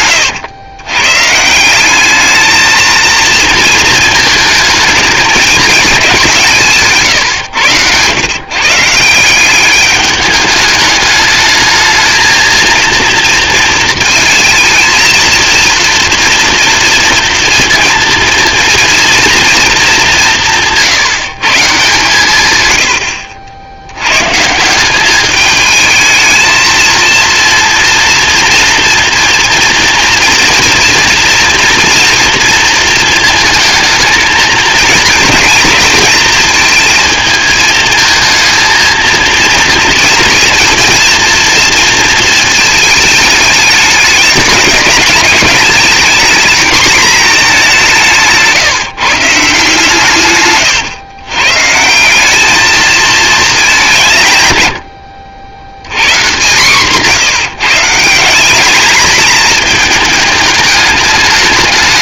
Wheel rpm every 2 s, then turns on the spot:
110, 220, 220, 170, 130, 210, 230, 220, 230, 230, 180, 130, 170, 220, 230, 240, 230, 220, 220, 220, 230, 220, 210, 230, 150, 130, 210, 120, 150, 210, 210.
50-52